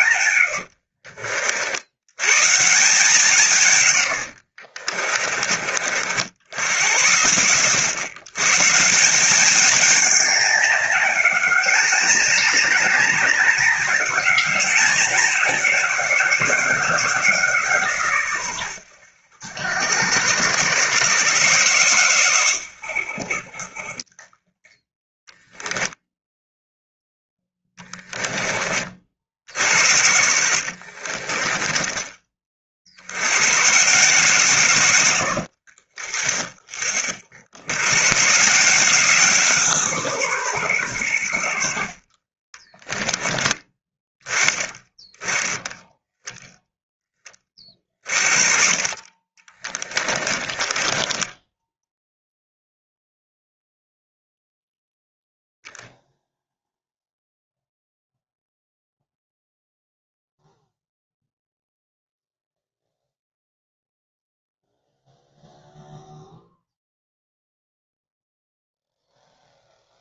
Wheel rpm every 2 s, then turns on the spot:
60, 160, 30, 80, 170, 220, 220, 210, 190, 90, 120, 70, 10, 0, 50, 50, 80, 110, 30, 170, 110, 20, 10, 10, 30, 10, 0, 0, 0, 0, 0, 0, 0, 0, 0.
0-2 4-6 24-26 30-32 42-44 50-52